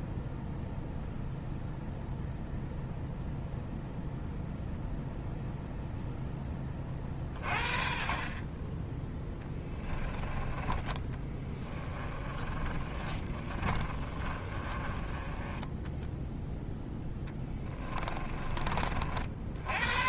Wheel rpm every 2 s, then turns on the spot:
0, 0, 0, 30, 10, 20, 30, 30, 10, 40.
8-16